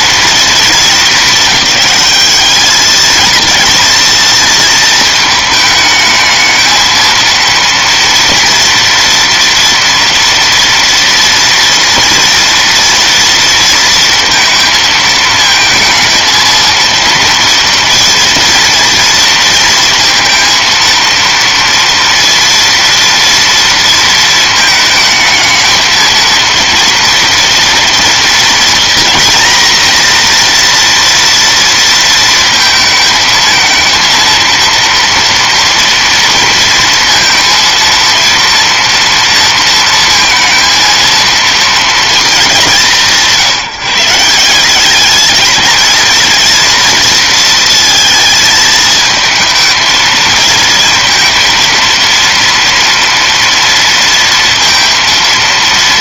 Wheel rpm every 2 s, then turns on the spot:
220, 210, 230, 220, 230, 230, 230, 220, 220, 230, 230, 230, 220, 230, 230, 240, 220, 230, 230, 230, 230, 170, 190, 230, 220, 230, 230, 230.
none